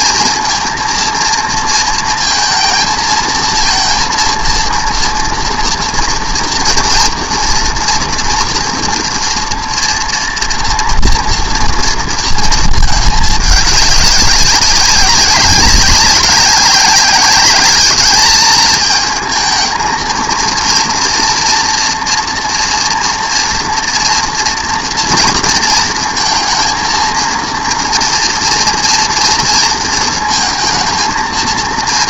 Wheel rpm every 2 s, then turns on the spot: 230, 230, 240, 240, 230, 230, 210, 190, 210, 220, 230, 230, 230, 230, 230, 230.
none